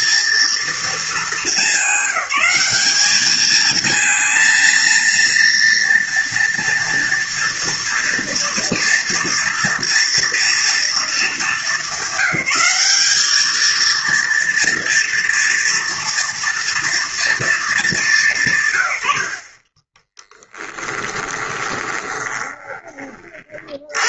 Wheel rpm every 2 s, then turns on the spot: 230, 200, 230, 230, 230, 230, 190, 240, 230, 140, 10, 20.
20-22